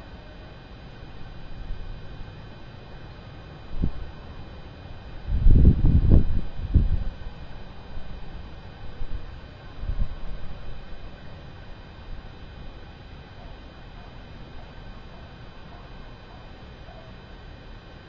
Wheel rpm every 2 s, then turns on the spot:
0, 0, 0, 0, 0, 0, 0, 0, 0.
none